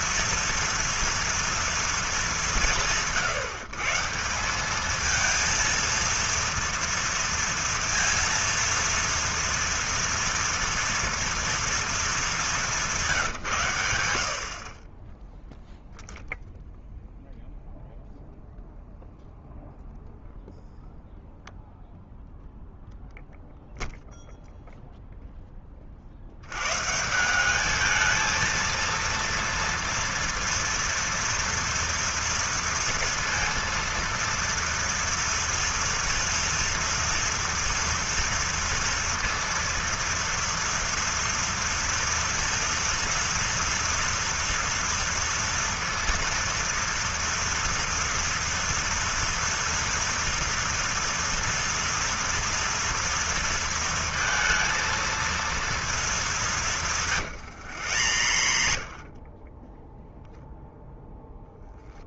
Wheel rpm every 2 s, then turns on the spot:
230, 140, 220, 230, 230, 230, 190, 30, 0, 0, 0, 0, 0, 150, 230, 230, 230, 230, 230, 230, 230, 230, 230, 230, 230, 230, 230, 230, 160, 50, 0.
56-58